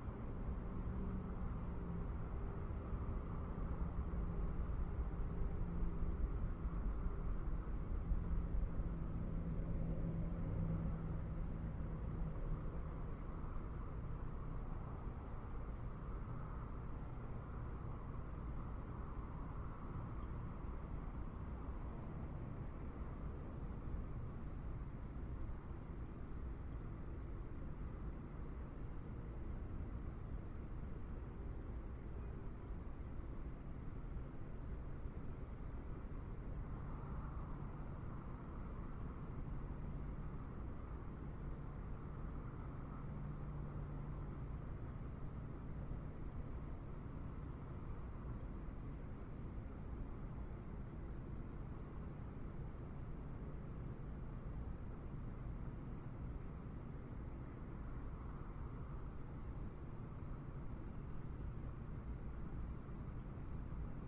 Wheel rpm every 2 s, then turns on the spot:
0, 0, 0, 0, 0, 0, 0, 0, 0, 0, 0, 0, 0, 0, 0, 0, 0, 0, 0, 0, 0, 0, 0, 0, 0, 0, 0, 0, 0, 0, 0, 0.
none